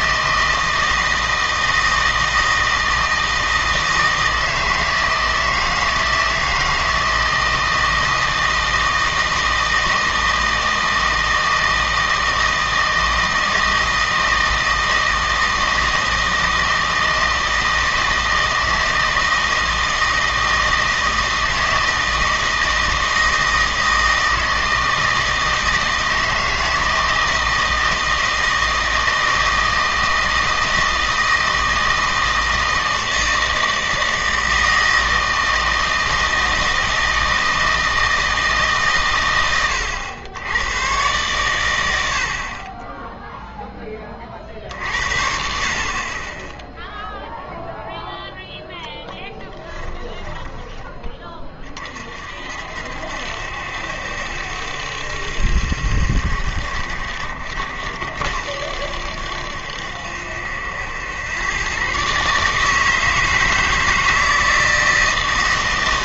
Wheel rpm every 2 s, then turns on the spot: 160, 160, 160, 160, 160, 160, 160, 160, 160, 160, 160, 160, 160, 160, 160, 160, 160, 160, 160, 140, 110, 30, 50, 0, 10, 10, 60, 70, 60, 70, 80, 150, 160.
none